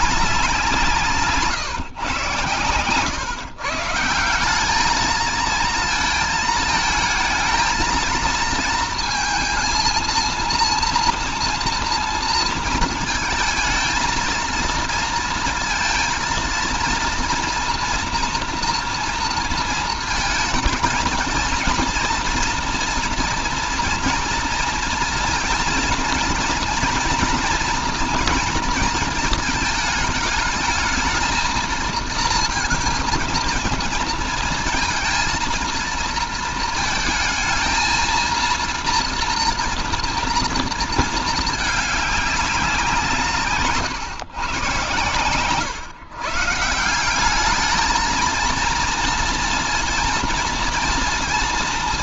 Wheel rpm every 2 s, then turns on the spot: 180, 130, 190, 220, 220, 230, 230, 230, 230, 230, 220, 240, 230, 230, 230, 220, 230, 230, 230, 230, 230, 200, 130, 130, 220, 230.
none